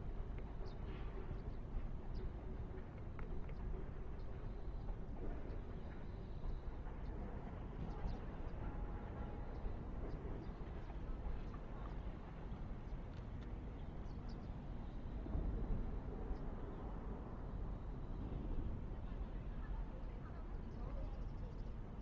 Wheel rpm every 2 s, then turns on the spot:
0, 0, 0, 0, 0, 0, 0, 0, 0, 0, 0.
none